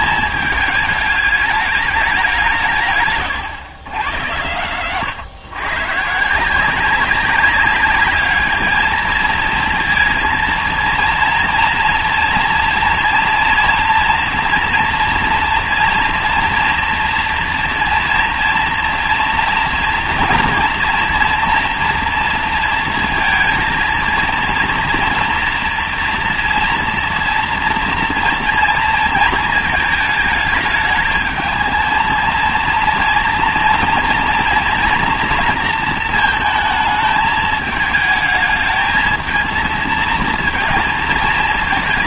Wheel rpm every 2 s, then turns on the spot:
210, 150, 120, 180, 220, 230, 240, 230, 230, 240, 240, 230, 230, 230, 230, 220, 230, 230, 220, 220, 230.
none